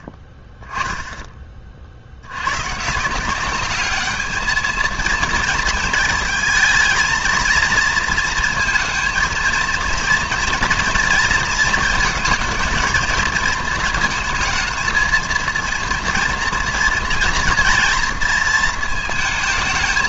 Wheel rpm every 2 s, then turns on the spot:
10, 120, 220, 230, 230, 230, 220, 220, 230, 230.
none